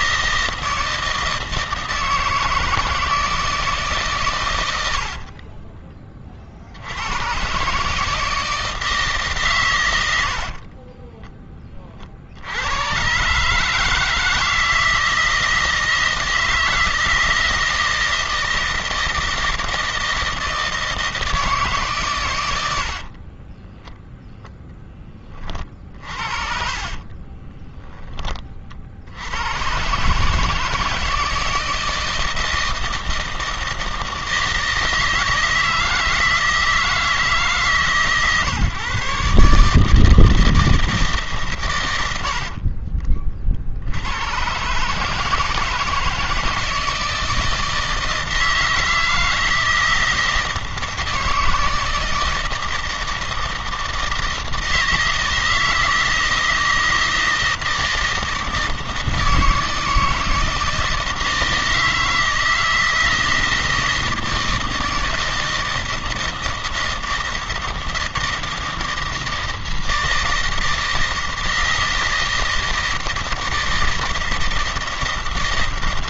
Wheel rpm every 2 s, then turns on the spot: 160, 160, 100, 60, 160, 50, 90, 160, 160, 160, 160, 90, 0, 50, 30, 150, 160, 160, 160, 140, 160, 70, 120, 160, 160, 160, 160, 160, 160, 160, 160, 160, 160, 160, 160, 160, 160, 160.
10-12 22-24 26-28